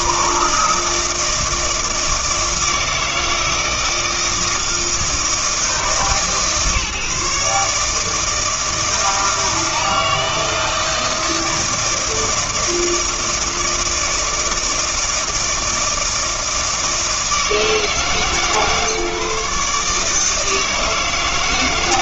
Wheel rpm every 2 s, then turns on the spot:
160, 160, 160, 150, 160, 160, 160, 160, 160, 150, 160.
none